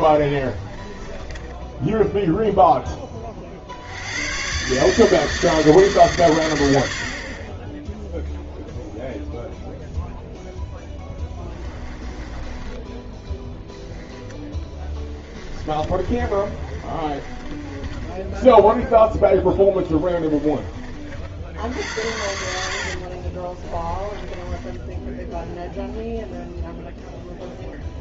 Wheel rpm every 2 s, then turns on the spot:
20, 0, 120, 110, 0, 0, 20, 20, 30, 10, 20, 70, 20, 0.
0-2 12-20 24-26